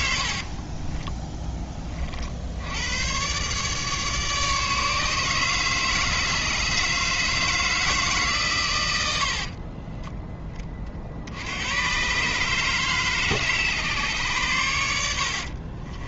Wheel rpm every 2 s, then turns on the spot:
30, 110, 150, 150, 100, 50, 140, 90.
0-2